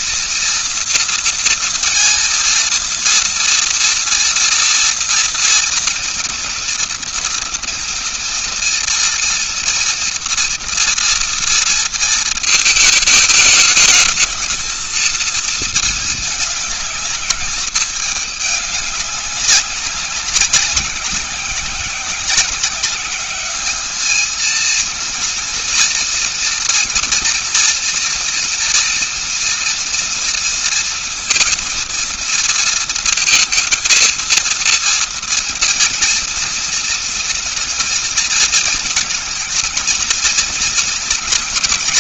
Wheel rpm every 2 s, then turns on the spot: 230, 230, 230, 240, 230, 230, 220, 220, 220, 210, 200, 190, 220, 240, 230, 230, 230, 230, 230, 230, 230.
none